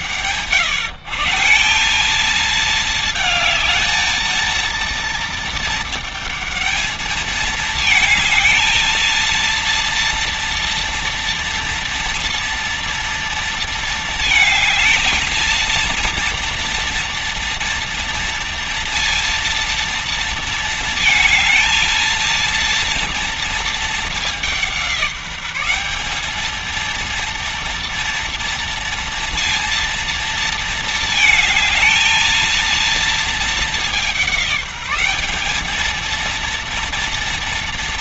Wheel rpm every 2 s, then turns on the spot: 140, 220, 230, 220, 220, 230, 230, 220, 230, 230, 220, 230, 180, 230, 230, 220, 230, 190, 230.
none